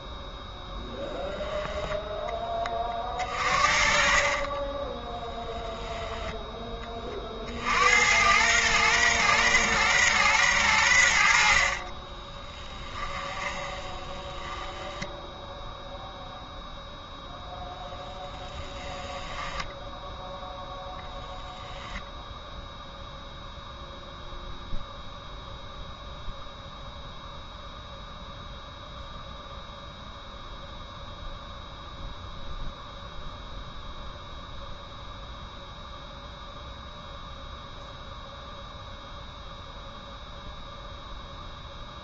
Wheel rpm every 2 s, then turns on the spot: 0, 40, 10, 30, 120, 80, 10, 10, 0, 10, 0, 0, 0, 0, 0, 0, 0, 0, 0, 0, 0.
2-6 12-16 18-20